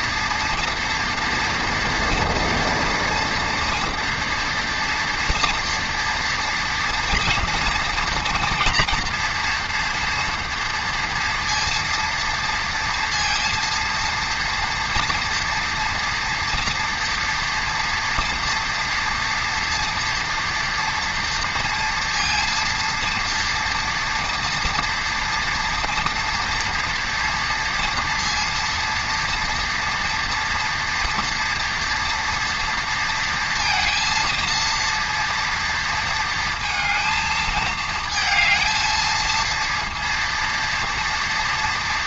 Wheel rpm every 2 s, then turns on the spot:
230, 230, 240, 230, 230, 230, 230, 230, 240, 230, 230, 230, 230, 230, 230, 230, 230, 230, 230, 220, 230.
none